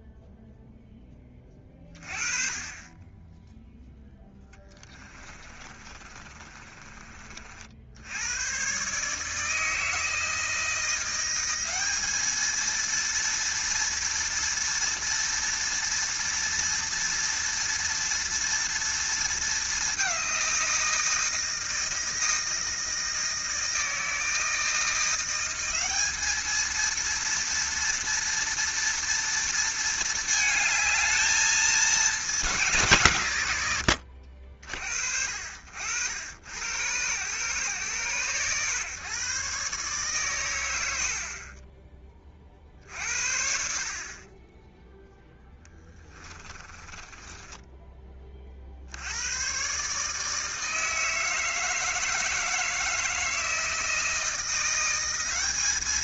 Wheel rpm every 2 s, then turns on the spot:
10, 10, 20, 30, 130, 170, 230, 230, 230, 230, 170, 160, 170, 230, 230, 220, 170, 50, 110, 120, 100, 50, 10, 20, 60, 160, 160, 170.
4-8 46-48